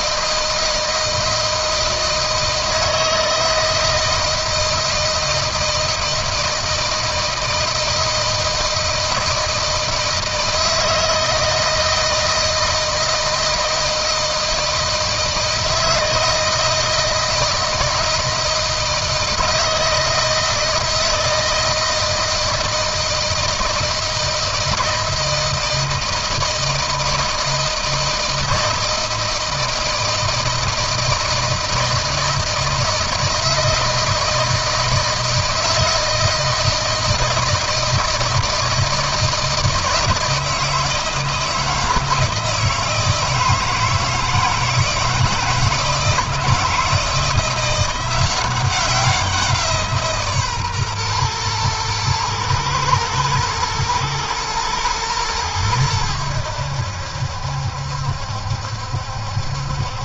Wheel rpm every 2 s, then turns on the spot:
160, 160, 160, 160, 160, 160, 160, 160, 160, 160, 160, 160, 160, 170, 160, 160, 160, 160, 160, 160, 160, 160, 160, 160, 190, 130, 120, 110, 70, 70.
none